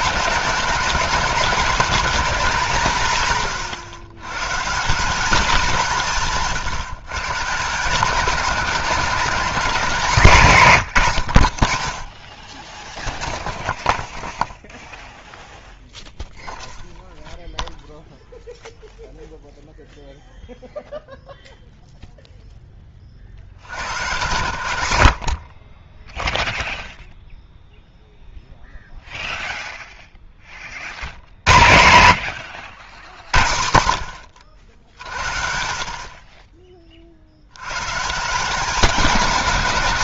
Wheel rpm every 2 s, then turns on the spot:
220, 190, 150, 150, 200, 180, 20, 0, 0, 0, 0, 10, 90, 0, 0, 50, 90, 90, 30, 190.
none